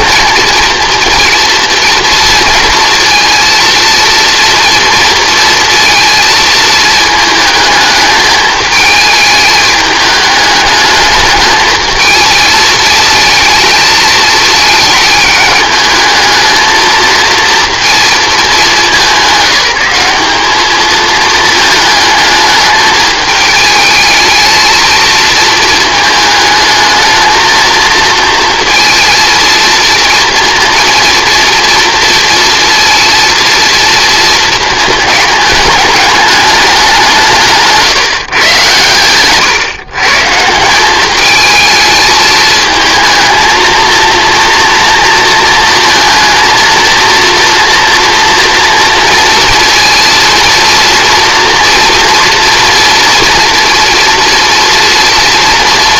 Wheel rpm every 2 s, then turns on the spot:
230, 230, 230, 220, 220, 210, 220, 210, 220, 190, 220, 220, 220, 220, 230, 230, 230, 220, 170, 110, 200, 220, 230, 230, 230, 230, 230, 230.
none